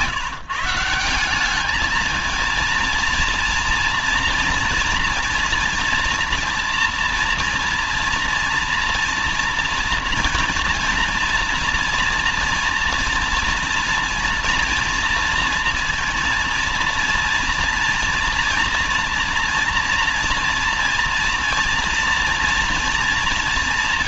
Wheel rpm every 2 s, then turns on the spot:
160, 220, 230, 230, 230, 230, 240, 240, 230, 230, 230, 230.
none